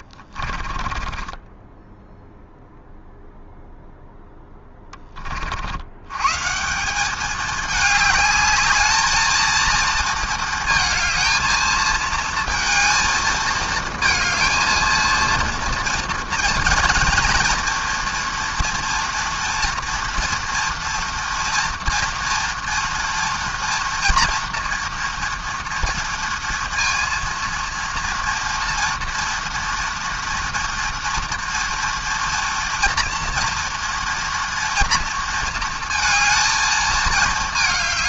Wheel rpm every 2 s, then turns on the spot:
30, 0, 20, 180, 220, 220, 230, 230, 230, 230, 230, 230, 230, 230, 230, 230, 230, 230, 220.
0-2